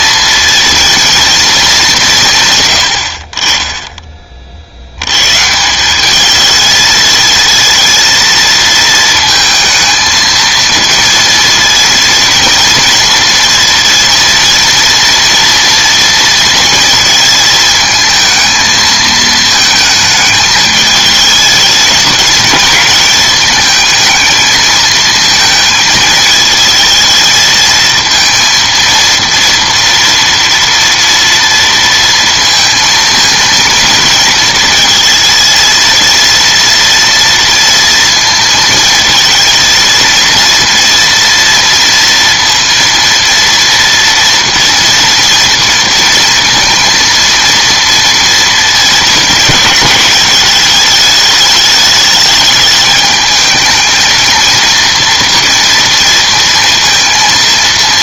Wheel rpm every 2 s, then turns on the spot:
230, 120, 60, 220, 230, 220, 230, 230, 230, 220, 210, 220, 220, 220, 230, 230, 230, 230, 230, 230, 230, 230, 230, 230, 230, 210, 210, 230, 230.
none